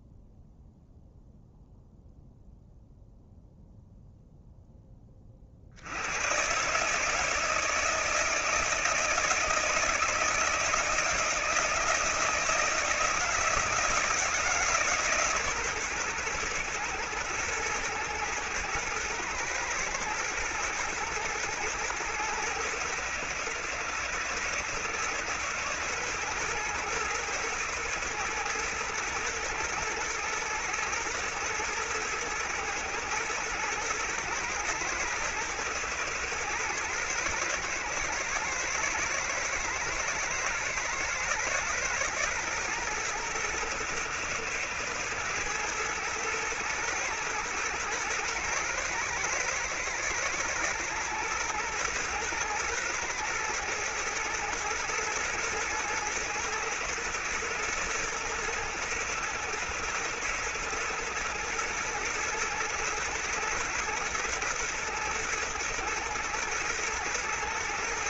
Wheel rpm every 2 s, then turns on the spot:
0, 0, 30, 160, 160, 160, 160, 140, 120, 110, 110, 110, 120, 120, 110, 110, 110, 110, 120, 110, 110, 110, 110, 110, 110, 110, 120, 110, 110, 110, 110, 110, 110, 110.
none